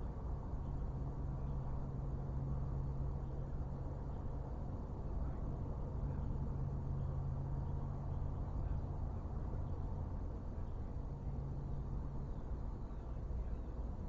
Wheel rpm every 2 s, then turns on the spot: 0, 0, 0, 0, 0, 0, 0.
none